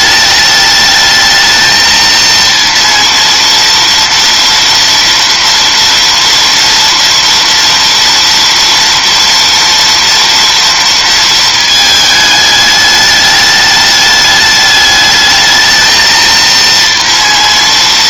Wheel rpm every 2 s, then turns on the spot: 210, 230, 230, 230, 230, 230, 210, 210, 230.
none